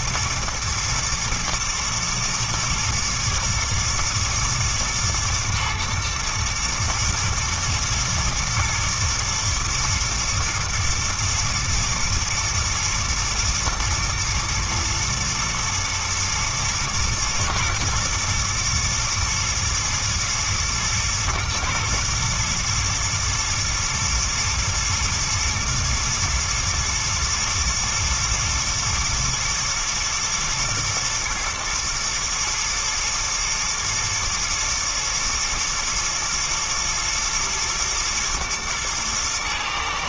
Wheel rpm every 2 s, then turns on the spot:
120, 110, 120, 110, 110, 120, 110, 110, 110, 110, 110, 120, 120, 120, 110, 120, 110, 120, 110, 110.
none